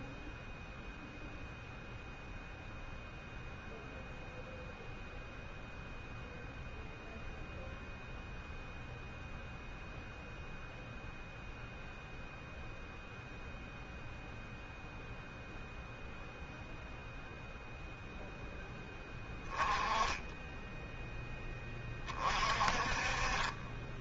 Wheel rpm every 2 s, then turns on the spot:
0, 0, 0, 0, 0, 0, 0, 0, 10, 10, 30, 10.
none